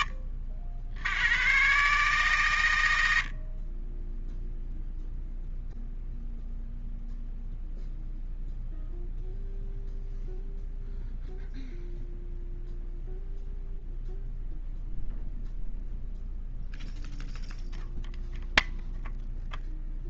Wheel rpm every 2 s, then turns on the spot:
90, 80, 0, 0, 0, 0, 0, 0, 0, 0.
none